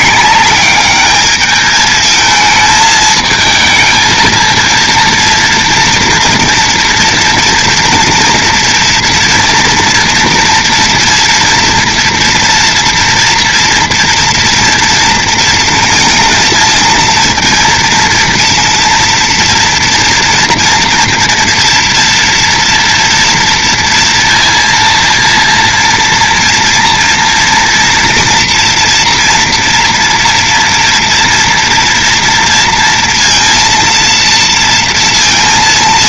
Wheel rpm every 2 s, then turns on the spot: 210, 220, 230, 240, 230, 230, 240, 230, 230, 230, 230, 230, 230, 230, 240, 230, 230, 230.
none